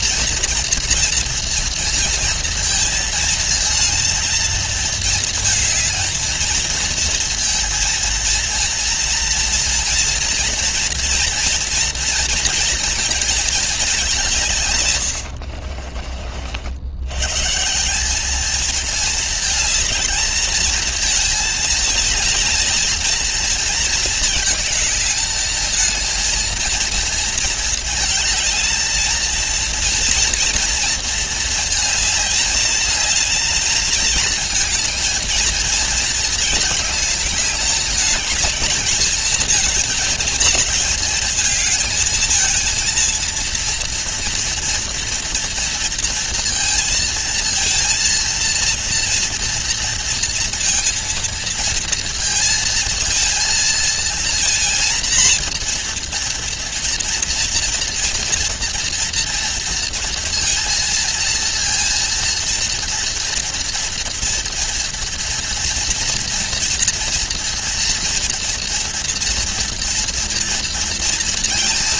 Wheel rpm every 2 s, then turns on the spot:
230, 230, 220, 230, 230, 240, 230, 140, 60, 220, 230, 220, 220, 230, 220, 230, 220, 220, 230, 220, 230, 230, 230, 230, 230, 230, 230, 230, 230, 230, 230, 230, 230, 230, 230, 230.
none